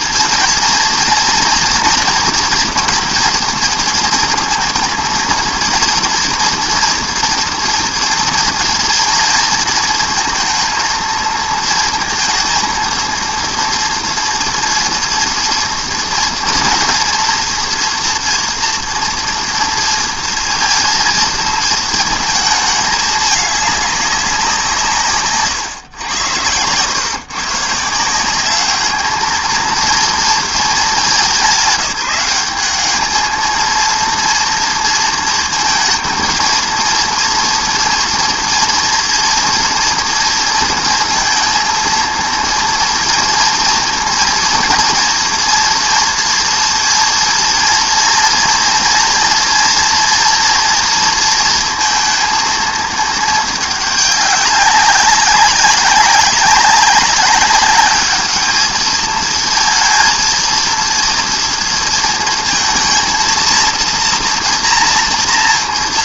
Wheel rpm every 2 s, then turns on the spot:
230, 230, 230, 240, 230, 230, 230, 230, 230, 230, 230, 220, 170, 110, 200, 210, 200, 230, 230, 230, 230, 230, 230, 240, 230, 240, 220, 200, 200, 220, 230, 230, 230.
none